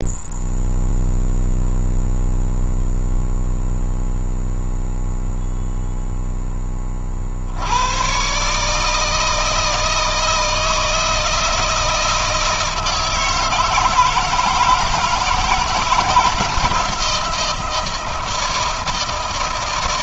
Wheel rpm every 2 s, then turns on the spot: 0, 0, 0, 20, 150, 160, 160, 160, 160, 160.
none